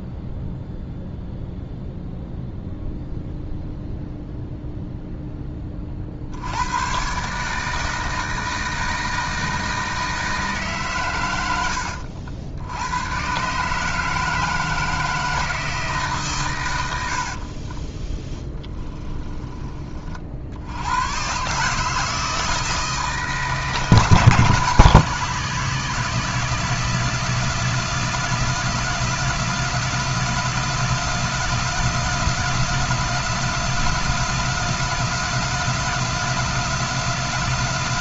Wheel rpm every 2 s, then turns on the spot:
0, 0, 0, 100, 160, 140, 90, 160, 100, 10, 80, 160, 160, 170, 170, 170, 170, 180, 180.
18-20